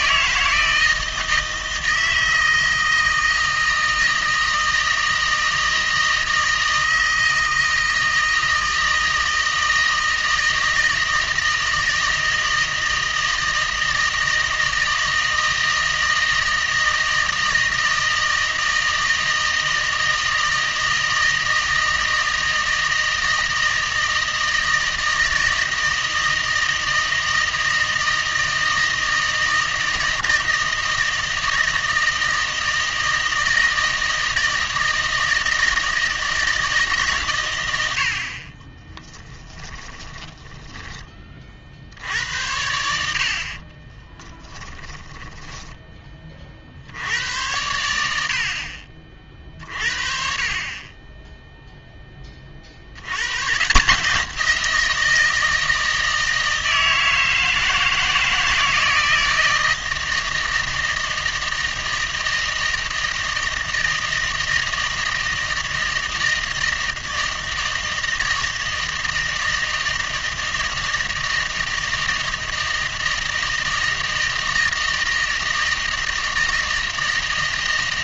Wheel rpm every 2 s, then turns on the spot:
160, 160, 160, 160, 160, 160, 160, 160, 160, 160, 160, 160, 160, 160, 160, 160, 160, 160, 150, 20, 20, 70, 10, 70, 40, 20, 60, 170, 160, 160, 160, 160, 160, 160, 160, 160, 160, 160, 160.
38-40 44-46